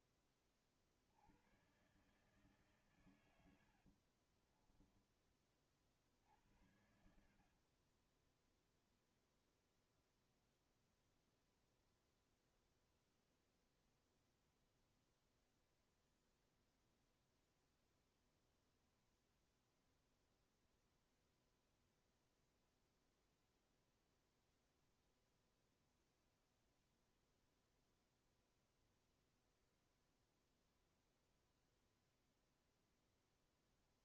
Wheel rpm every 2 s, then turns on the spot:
40, 130, 30, 70, 0, 0, 0, 0, 0, 0, 0, 0, 0, 0, 0, 0, 0.
6-8